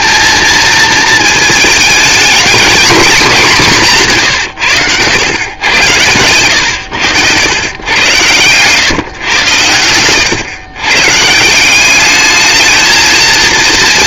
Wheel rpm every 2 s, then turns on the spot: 220, 230, 110, 100, 120, 130, 220.
none